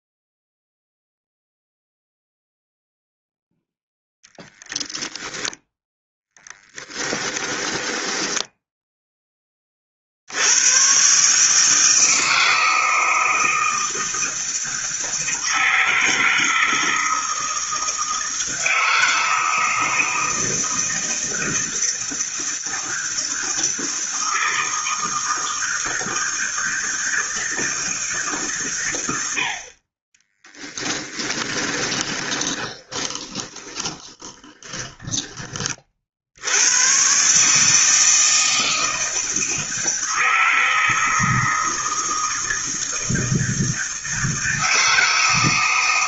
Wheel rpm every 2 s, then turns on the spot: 0, 0, 20, 10, 10, 100, 160, 160, 160, 160, 160, 160, 160, 160, 140, 10, 20, 10, 100, 160, 160, 160, 160.
6-10 30-36